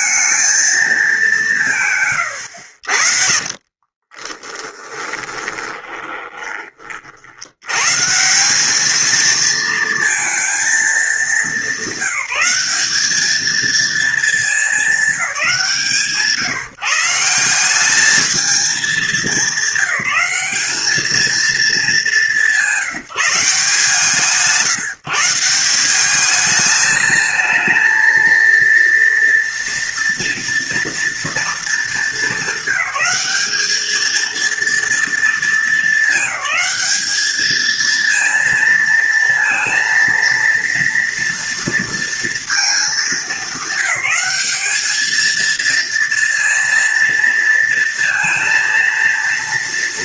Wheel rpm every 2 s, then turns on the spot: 220, 80, 20, 30, 190, 220, 190, 220, 150, 210, 200, 190, 150, 210, 230, 240, 220, 230, 210, 230, 230, 220, 200, 230, 230.
2-6